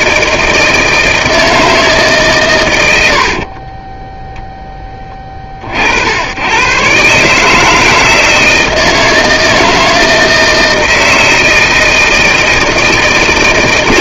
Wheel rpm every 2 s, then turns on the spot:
160, 120, 10, 110, 160, 160, 160.
none